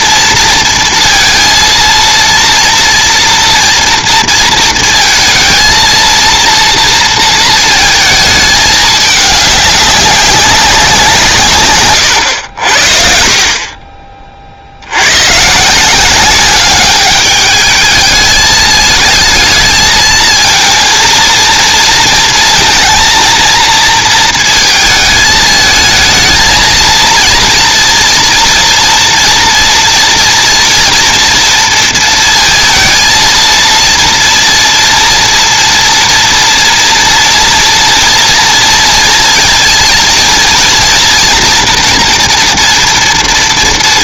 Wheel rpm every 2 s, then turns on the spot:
230, 230, 230, 230, 210, 190, 80, 50, 200, 220, 230, 230, 220, 230, 240, 230, 230, 230, 230, 230, 230, 240.
none